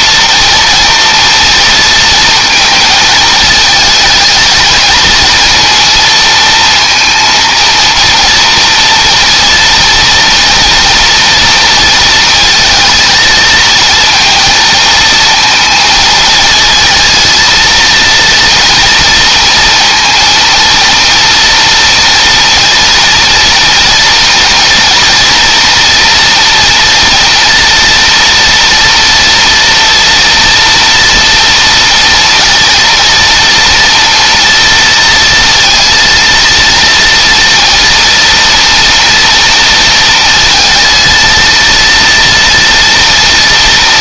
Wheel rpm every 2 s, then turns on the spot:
230, 220, 220, 230, 230, 230, 230, 230, 220, 230, 230, 230, 230, 230, 230, 230, 230, 230, 230, 230, 230, 230.
none